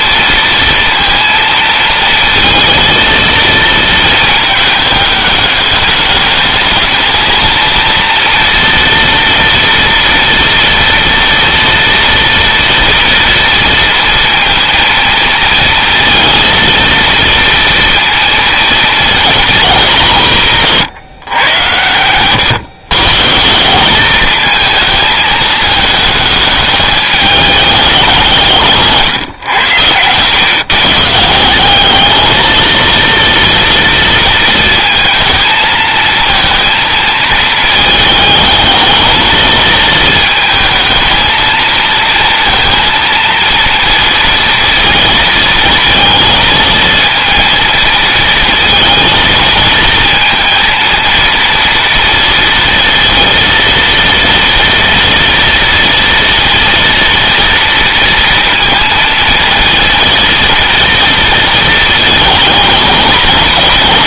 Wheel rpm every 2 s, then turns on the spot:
230, 230, 210, 220, 230, 230, 230, 230, 230, 230, 150, 140, 220, 210, 150, 160, 230, 230, 230, 220, 220, 230, 230, 230, 230, 230, 230, 230, 230, 230, 230, 230.
none